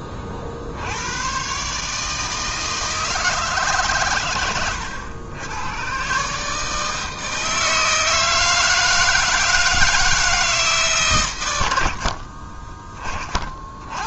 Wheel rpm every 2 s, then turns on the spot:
80, 160, 100, 160, 160, 150, 20.
12-14